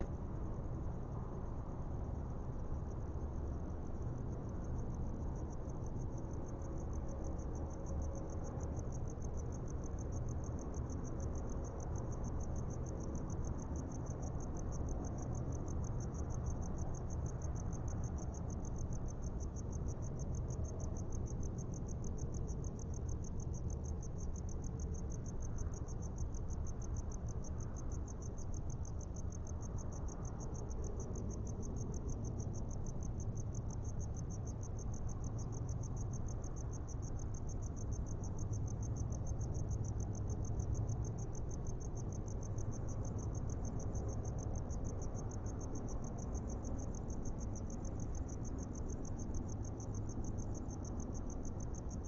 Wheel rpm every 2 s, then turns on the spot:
0, 0, 0, 0, 0, 0, 0, 0, 0, 0, 0, 0, 0, 0, 0, 0, 0, 0, 0, 0, 0, 0, 0, 0, 0, 0.
none